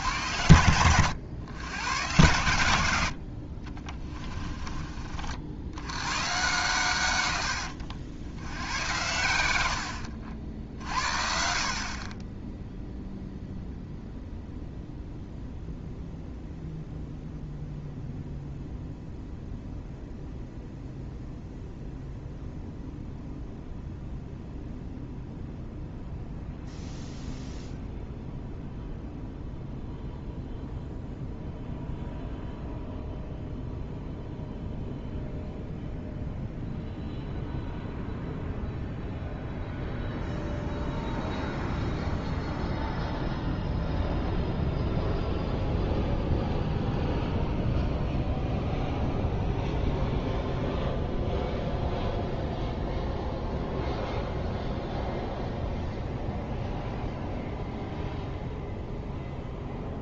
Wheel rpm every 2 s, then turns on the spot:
80, 90, 30, 130, 90, 50, 10, 0, 0, 0, 0, 0, 0, 0, 0, 0, 0, 0, 0, 0, 0, 0, 0, 0, 0, 0, 0, 0, 0, 0.
0-2 4-6